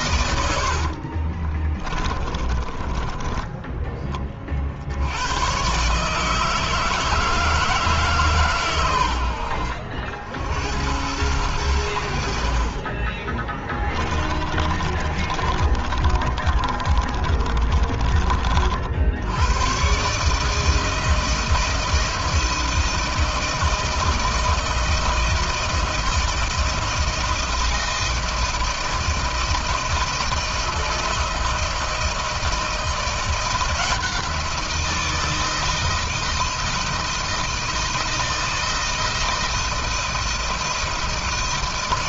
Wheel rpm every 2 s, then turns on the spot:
80, 30, 50, 160, 120, 90, 40, 30, 30, 50, 160, 160, 160, 160, 160, 160, 160, 170, 160, 160, 160.
0-4 14-18